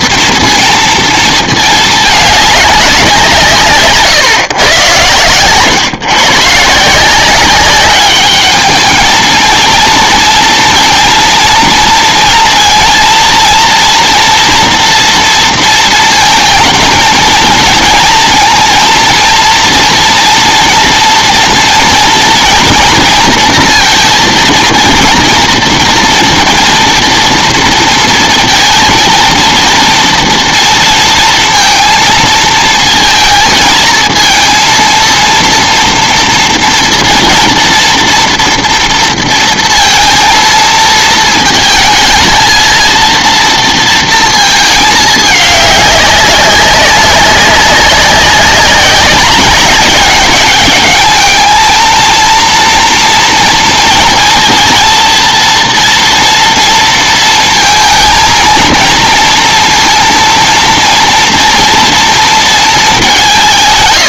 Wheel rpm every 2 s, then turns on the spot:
230, 200, 130, 150, 210, 230, 230, 230, 230, 230, 230, 230, 230, 230, 230, 230, 230, 230, 240, 230, 230, 220, 220, 190, 200, 210, 230, 230, 230, 230, 230, 220.
none